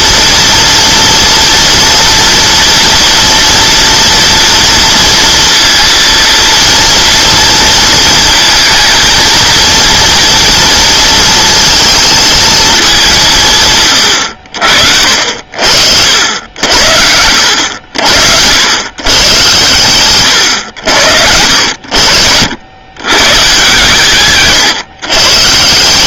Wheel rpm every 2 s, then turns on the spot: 230, 230, 230, 230, 230, 230, 220, 70, 70, 100, 100, 100, 140.
none